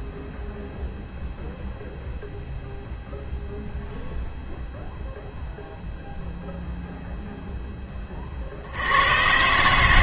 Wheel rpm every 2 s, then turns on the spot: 0, 0, 0, 0, 60.
none